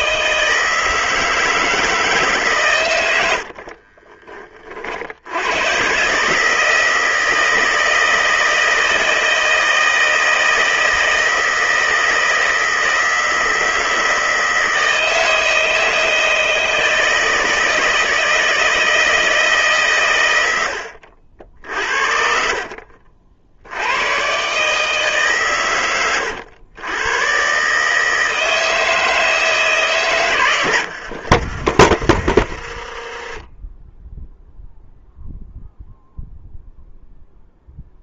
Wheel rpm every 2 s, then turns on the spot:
160, 80, 80, 160, 160, 160, 160, 160, 160, 160, 70, 60, 140, 120, 160, 80, 30, 0, 20.
2-4 30-34